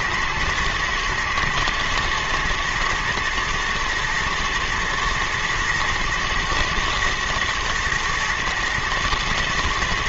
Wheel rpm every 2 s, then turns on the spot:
110, 110, 120, 110, 120.
none